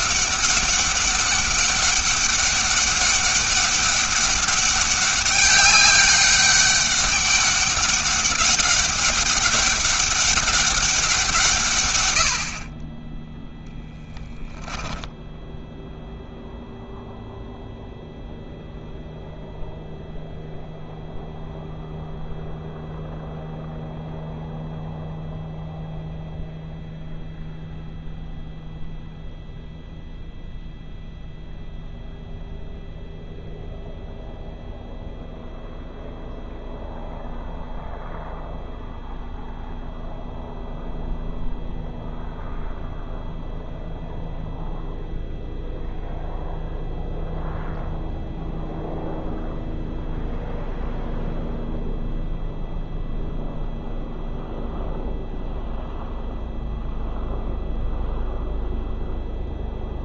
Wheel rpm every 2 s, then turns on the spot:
190, 200, 200, 200, 200, 190, 40, 10, 0, 0, 0, 0, 0, 0, 0, 0, 0, 0, 0, 0, 0, 0, 0, 0, 0, 0, 0, 0, 0, 0.
none